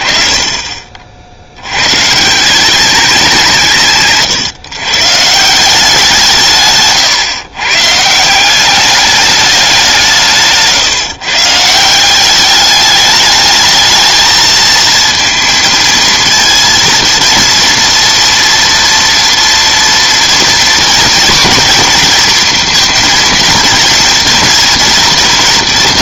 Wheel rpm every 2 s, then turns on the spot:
40, 190, 120, 140, 190, 150, 200, 220, 230, 230, 240, 230, 230.
none